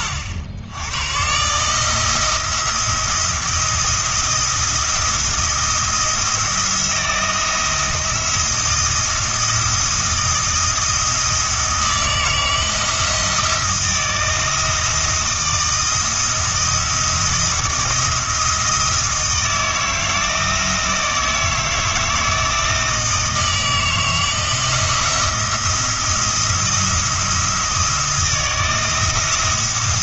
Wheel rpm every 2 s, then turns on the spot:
90, 170, 170, 170, 170, 160, 160, 170, 170, 160, 160, 160, 170, 170, 160.
none